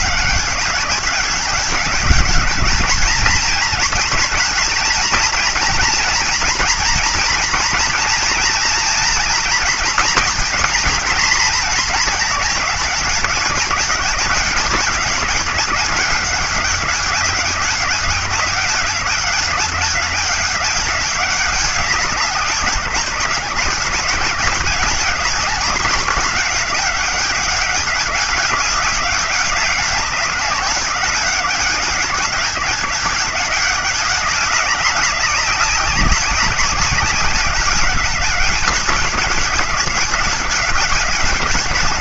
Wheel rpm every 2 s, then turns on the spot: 200, 210, 230, 240, 230, 230, 210, 190, 200, 190, 200, 180, 200, 200, 200, 190, 190, 200, 190, 190, 190.
none